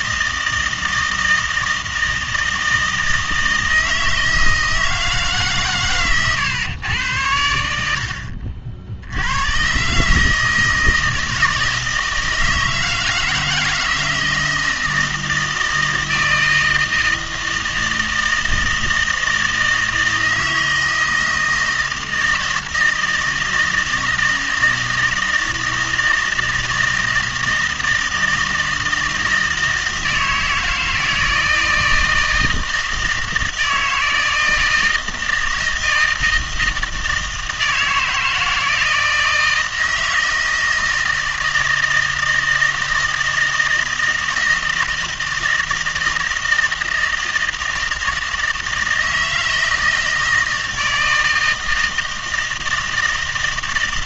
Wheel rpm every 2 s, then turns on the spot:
160, 160, 160, 110, 60, 160, 160, 170, 160, 160, 160, 160, 160, 160, 160, 160, 160, 160, 160, 160, 160, 160, 160, 160, 160, 160, 160.
none